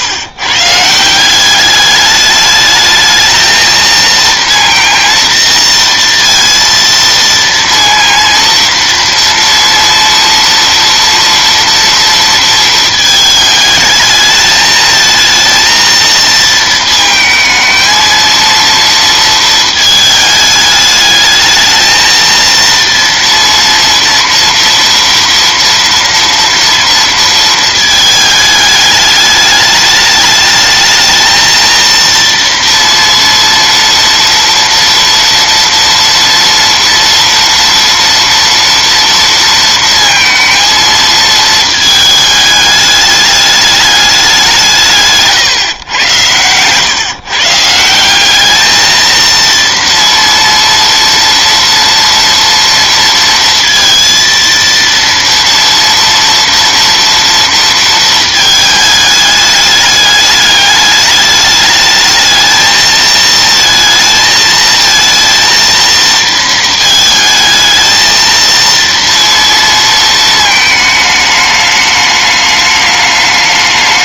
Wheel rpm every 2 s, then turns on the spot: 150, 220, 230, 230, 230, 240, 220, 220, 230, 230, 210, 230, 230, 230, 210, 220, 230, 230, 230, 230, 220, 210, 160, 130, 220, 230, 230, 230, 230, 220, 210, 220, 220, 230, 230, 220, 210.
none